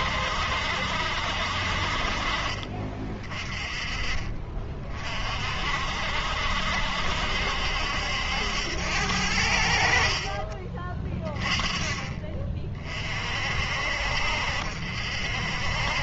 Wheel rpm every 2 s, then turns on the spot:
70, 40, 30, 60, 80, 40, 30, 50.
2-4 10-12